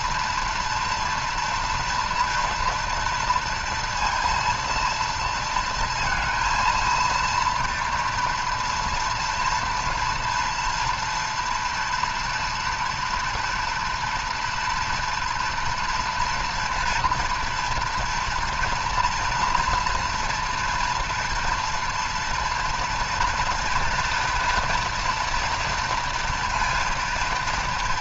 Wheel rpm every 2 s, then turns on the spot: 240, 230, 230, 230, 230, 240, 230, 230, 240, 230, 230, 230, 230, 230.
none